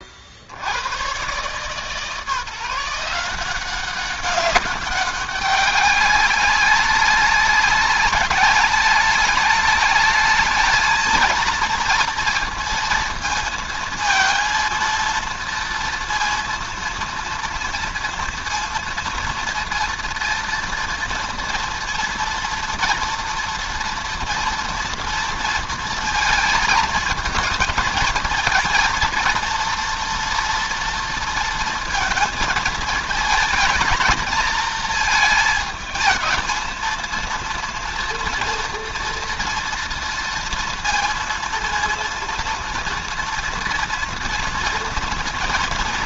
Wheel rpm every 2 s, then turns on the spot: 60, 160, 200, 200, 200, 220, 230, 230, 230, 230, 230, 230, 230, 220, 220, 230, 220, 230, 220, 230, 230, 230, 230.
none